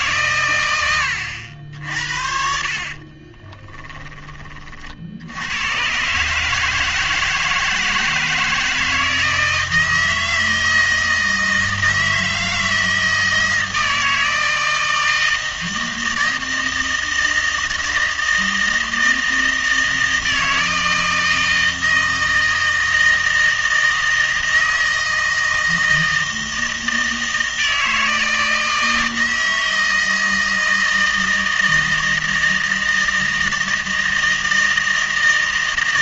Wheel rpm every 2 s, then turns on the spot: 110, 50, 40, 160, 160, 160, 160, 160, 160, 160, 160, 160, 160, 160, 160, 160, 160, 160.
none